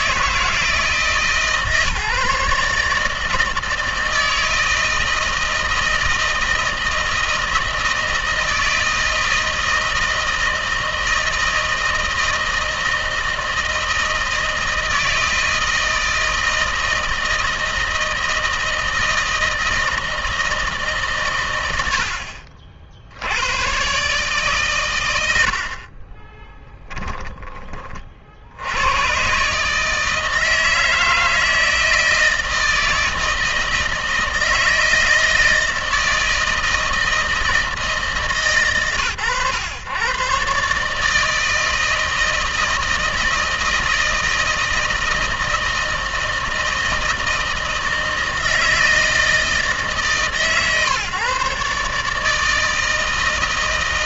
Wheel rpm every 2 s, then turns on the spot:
160, 150, 160, 160, 160, 160, 160, 160, 160, 160, 160, 50, 130, 20, 70, 160, 160, 160, 160, 140, 140, 160, 160, 160, 160, 140, 160.
26-28